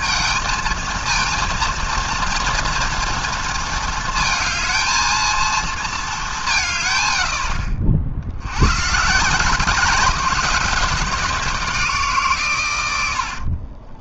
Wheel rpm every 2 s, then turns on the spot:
220, 230, 220, 220, 70, 190, 170.
none